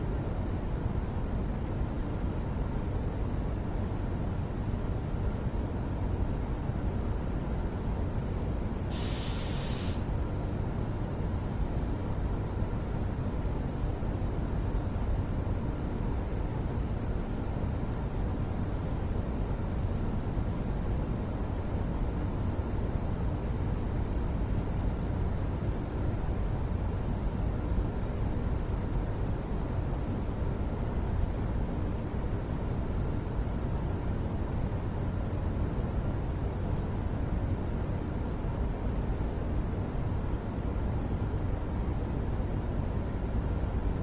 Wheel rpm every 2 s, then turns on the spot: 0, 0, 0, 0, 0, 0, 0, 0, 0, 0, 0, 0, 0, 0, 0, 0, 0, 0, 0, 0, 0, 0.
none